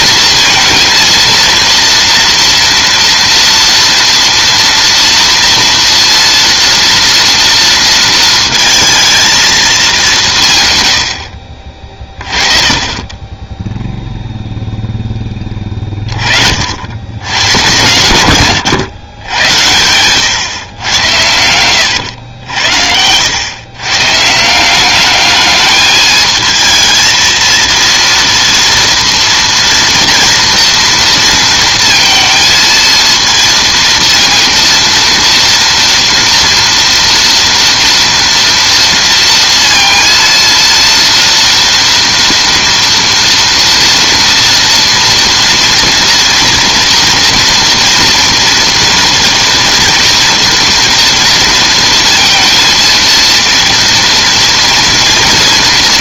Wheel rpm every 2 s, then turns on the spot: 230, 230, 230, 230, 230, 150, 20, 0, 60, 120, 110, 90, 170, 220, 230, 230, 220, 230, 230, 230, 230, 230, 240, 230, 230, 230, 230, 230.
18-20